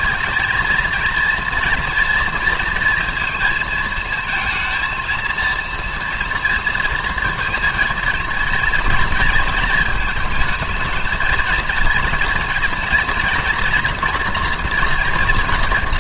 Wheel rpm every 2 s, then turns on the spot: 230, 230, 230, 230, 230, 220, 230, 230.
none